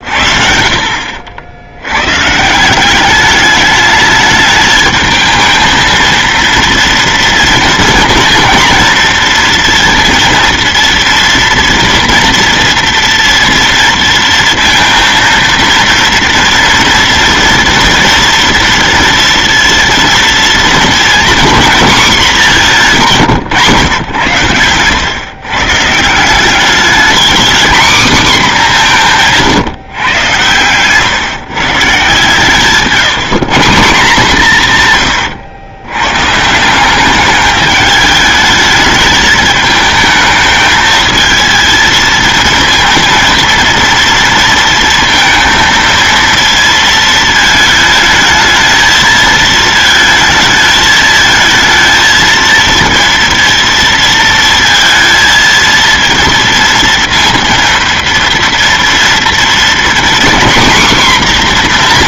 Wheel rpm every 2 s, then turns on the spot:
50, 130, 210, 230, 230, 230, 230, 230, 230, 230, 230, 210, 110, 180, 240, 120, 140, 160, 140, 210, 220, 230, 230, 230, 220, 220, 230, 230, 230, 230, 250.
none